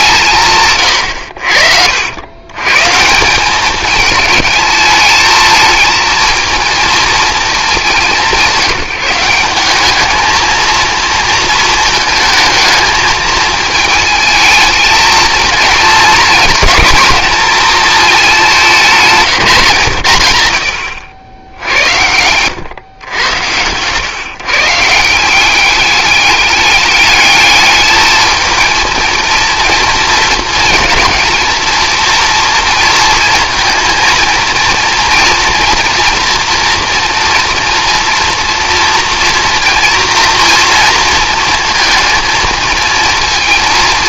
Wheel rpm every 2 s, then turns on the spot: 140, 130, 210, 230, 170, 230, 220, 220, 220, 200, 100, 110, 140, 210, 230, 230, 230, 230, 230, 230, 230, 230.
none